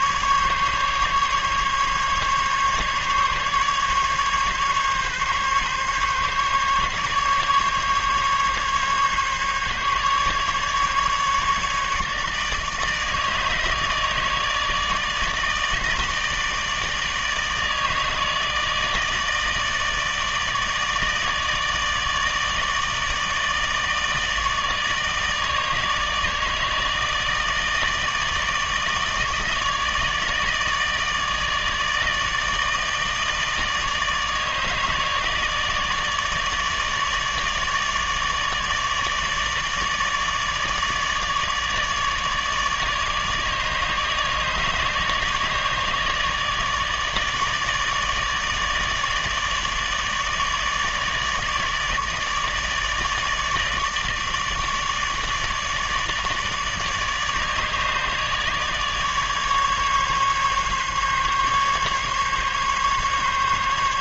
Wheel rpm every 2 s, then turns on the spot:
140, 140, 140, 140, 140, 150, 150, 160, 160, 160, 150, 150, 160, 150, 150, 160, 150, 150, 150, 150, 150, 150, 150, 150, 150, 150, 150, 150, 150, 150, 140, 140.
none